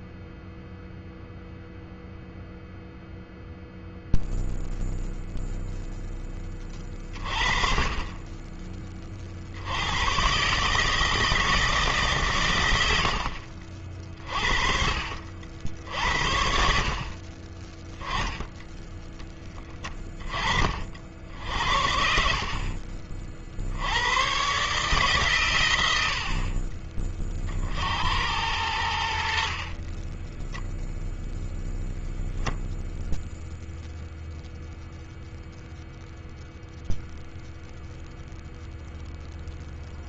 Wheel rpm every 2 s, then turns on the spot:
0, 0, 0, 30, 30, 150, 70, 50, 50, 10, 60, 40, 140, 30, 70, 0, 0, 0, 0, 0.
28-30